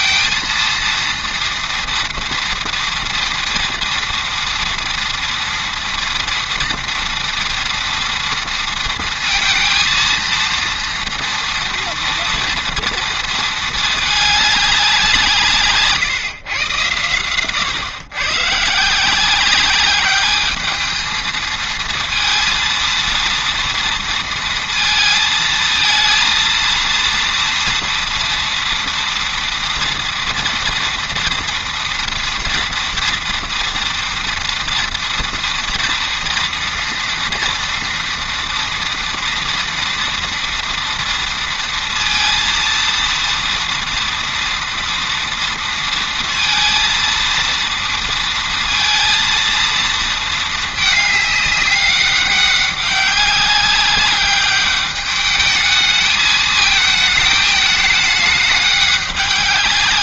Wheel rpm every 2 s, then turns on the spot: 230, 230, 230, 230, 230, 230, 230, 200, 130, 140, 210, 230, 230, 230, 230, 240, 230, 230, 230, 230, 230, 230, 230, 230, 230, 220, 200, 200, 220, 210.
none